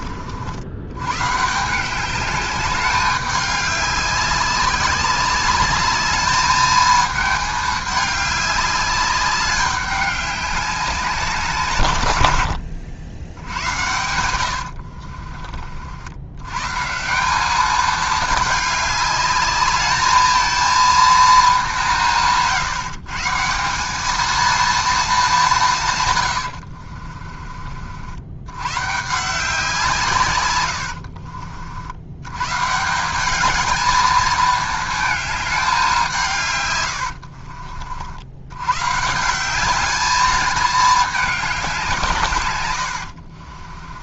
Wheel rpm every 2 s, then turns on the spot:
100, 200, 200, 220, 200, 190, 80, 70, 140, 200, 230, 150, 230, 60, 130, 80, 160, 220, 110, 130, 210, 100.
14-16 26-28 30-32 42-44